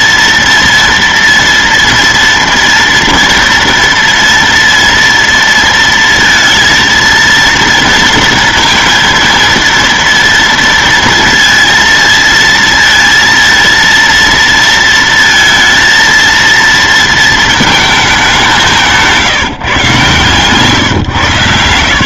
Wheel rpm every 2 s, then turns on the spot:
230, 230, 230, 230, 230, 230, 230, 230, 230, 180, 130.
none